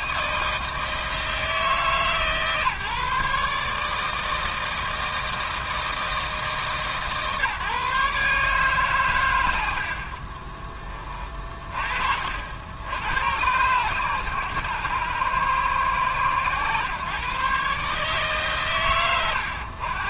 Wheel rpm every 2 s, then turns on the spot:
160, 150, 160, 140, 120, 30, 100, 100, 120, 100.
none